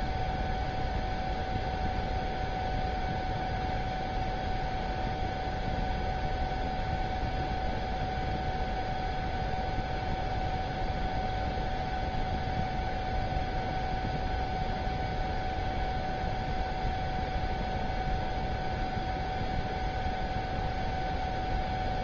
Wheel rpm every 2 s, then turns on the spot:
0, 0, 0, 0, 0, 0, 0, 0, 0, 0, 0.
none